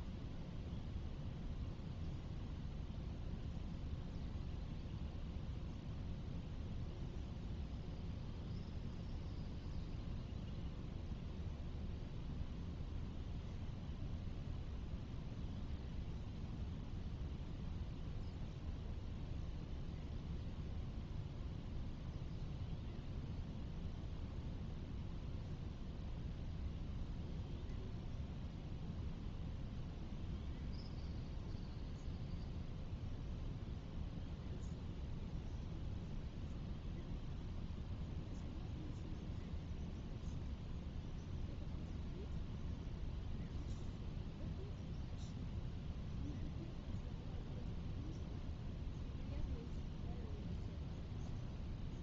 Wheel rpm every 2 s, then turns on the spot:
0, 0, 0, 0, 0, 0, 0, 0, 0, 0, 0, 0, 0, 0, 0, 0, 0, 0, 0, 0, 0, 0, 0, 0, 0, 0.
none